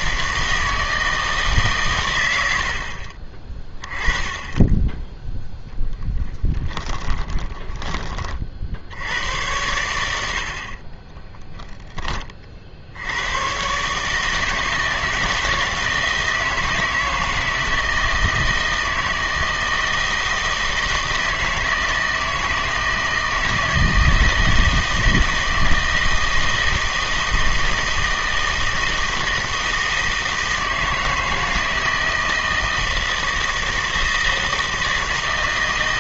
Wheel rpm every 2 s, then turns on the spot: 160, 60, 10, 10, 50, 50, 50, 160, 160, 160, 160, 160, 160, 160, 160, 160, 160, 160.
6-8